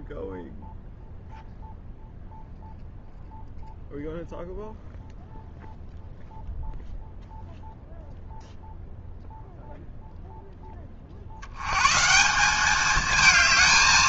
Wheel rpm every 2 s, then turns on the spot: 0, 0, 0, 0, 0, 60, 220.
none